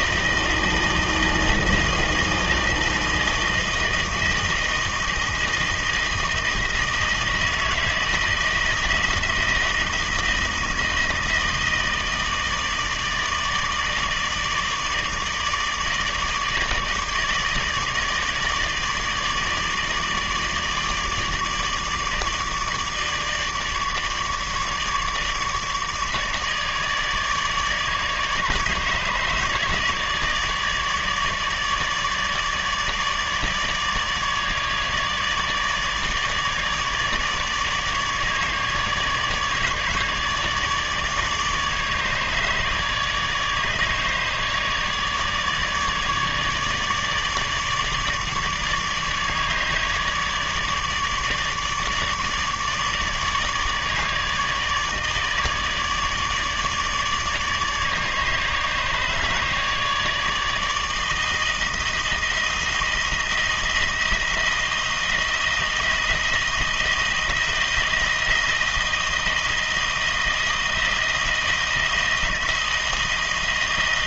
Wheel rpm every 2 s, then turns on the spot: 160, 160, 160, 160, 160, 160, 160, 160, 160, 150, 150, 160, 150, 150, 150, 160, 150, 150, 150, 150, 150, 150, 150, 150, 150, 150, 150, 150, 150, 150, 160, 160, 170, 160, 160, 160, 160.
none